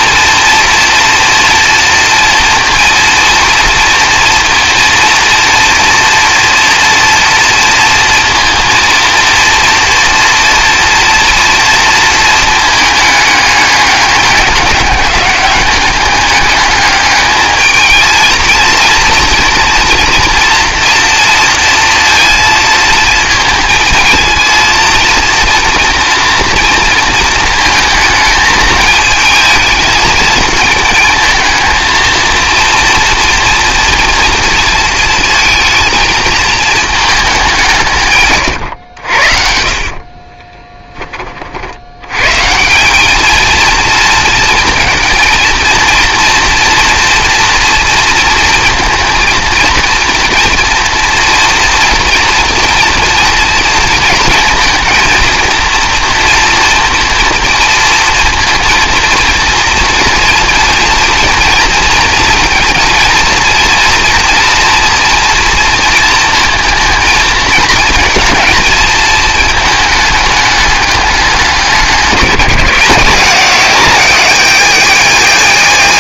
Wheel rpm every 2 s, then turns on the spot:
230, 230, 230, 230, 230, 240, 220, 200, 210, 220, 230, 220, 230, 230, 220, 220, 230, 230, 220, 120, 10, 170, 220, 240, 230, 240, 230, 230, 230, 230, 230, 230, 240, 230, 220, 210, 170, 190.
40-42